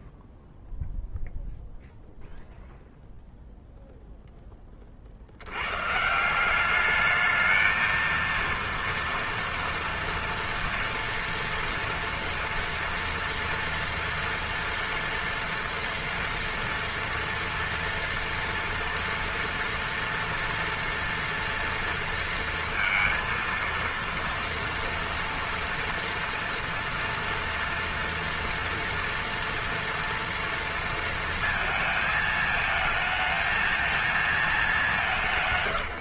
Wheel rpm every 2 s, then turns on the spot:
0, 0, 90, 220, 230, 230, 230, 230, 230, 230, 230, 230, 230, 230, 240, 230, 220, 180.
none